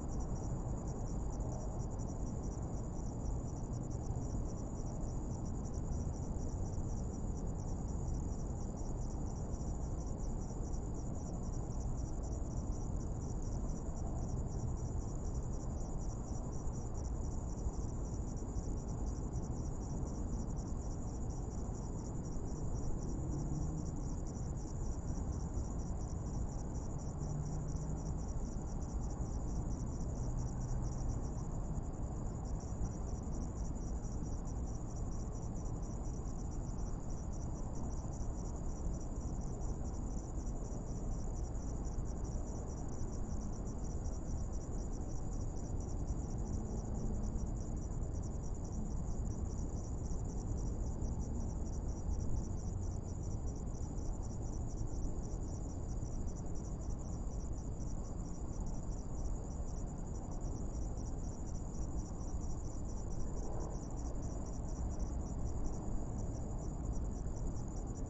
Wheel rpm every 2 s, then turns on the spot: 0, 0, 0, 0, 0, 0, 0, 0, 0, 0, 0, 0, 0, 0, 0, 0, 0, 0, 0, 0, 0, 0, 0, 0, 0, 0, 0, 0, 0, 0, 0, 0, 0, 0.
none